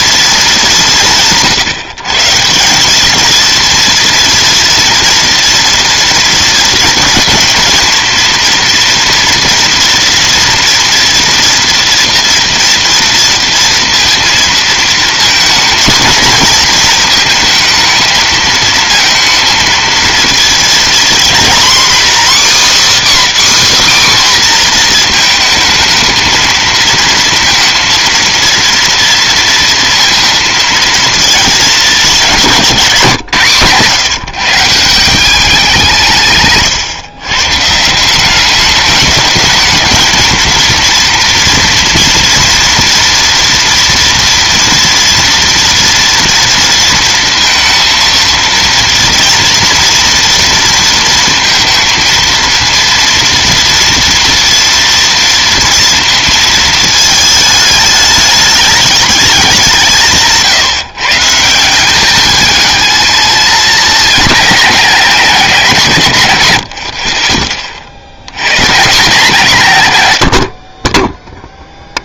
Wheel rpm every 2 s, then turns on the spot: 220, 160, 230, 230, 230, 230, 230, 230, 230, 220, 230, 280, 260, 220, 230, 230, 190, 160, 140, 190, 220, 230, 230, 230, 230, 230, 230, 230, 230, 210, 150, 210, 210, 110, 90, 80.
none